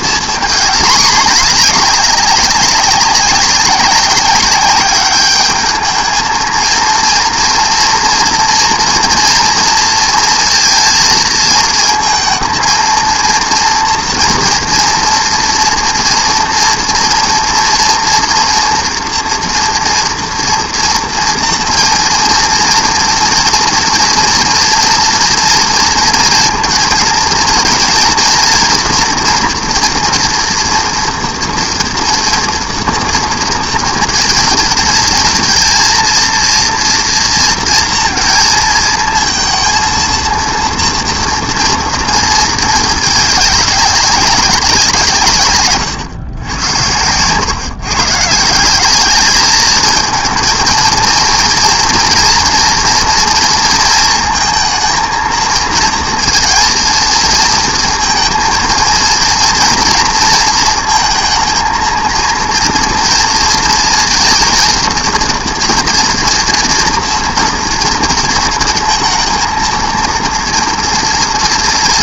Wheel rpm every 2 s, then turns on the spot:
230, 200, 200, 230, 230, 230, 230, 230, 230, 230, 230, 240, 230, 230, 240, 230, 230, 220, 230, 230, 230, 220, 180, 100, 180, 230, 240, 230, 230, 230, 230, 230, 230, 230, 220, 230.
none